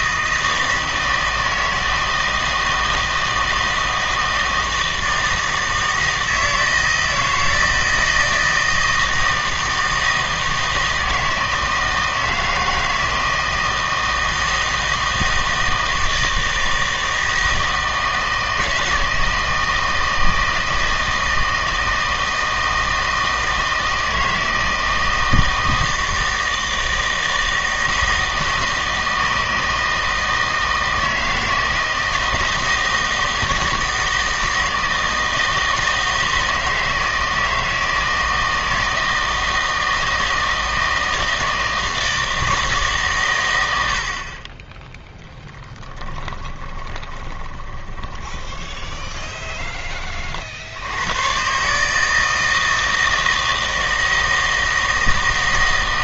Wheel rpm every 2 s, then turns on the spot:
160, 160, 160, 160, 160, 160, 160, 160, 160, 160, 160, 160, 160, 160, 160, 160, 160, 160, 160, 160, 160, 160, 20, 20, 20, 70, 160, 160.
46-50